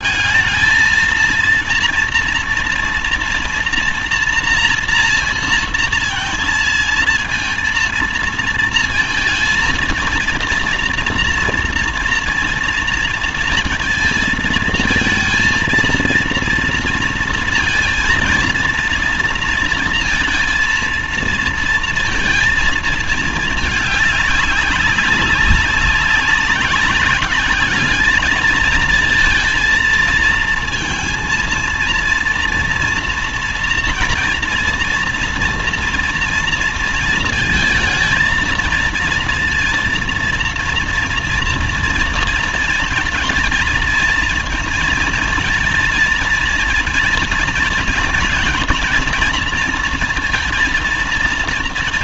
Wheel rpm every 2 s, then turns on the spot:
220, 230, 230, 220, 230, 230, 230, 230, 230, 230, 230, 230, 200, 190, 220, 230, 230, 230, 230, 230, 230, 230, 230, 230, 230, 230.
none